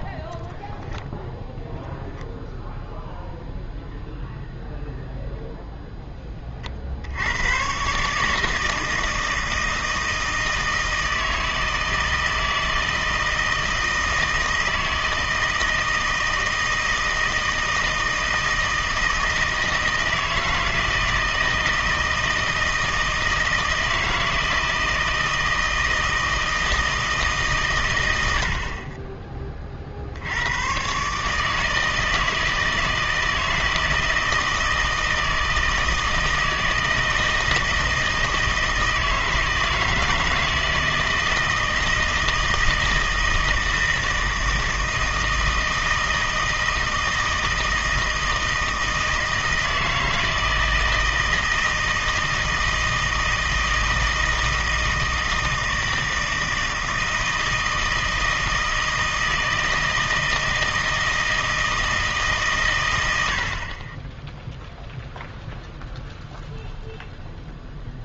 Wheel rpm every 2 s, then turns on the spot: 0, 0, 0, 50, 160, 160, 160, 160, 160, 160, 160, 160, 160, 160, 60, 110, 160, 160, 160, 160, 160, 160, 160, 160, 160, 160, 160, 160, 160, 160, 160, 130, 0, 0.
none